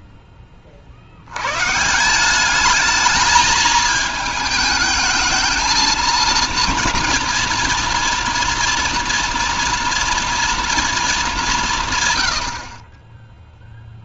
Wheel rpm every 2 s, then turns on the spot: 80, 220, 220, 230, 230, 190, 0.
none